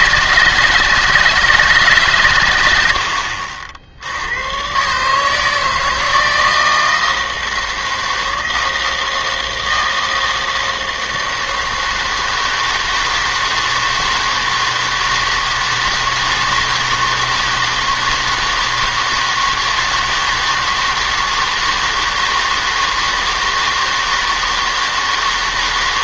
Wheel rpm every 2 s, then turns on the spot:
160, 100, 110, 160, 160, 160, 160, 160, 160, 160, 160, 160, 160.
none